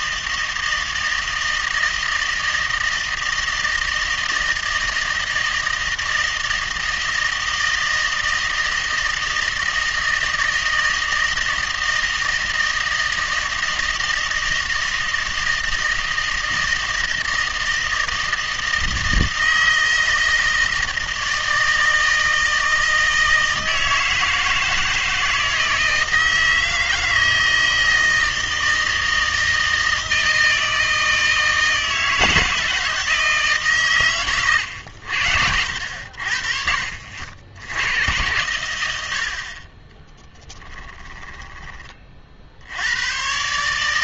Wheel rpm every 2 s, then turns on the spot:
160, 160, 160, 160, 160, 160, 160, 160, 160, 160, 160, 160, 160, 160, 160, 160, 160, 100, 50, 90, 10, 90.
40-42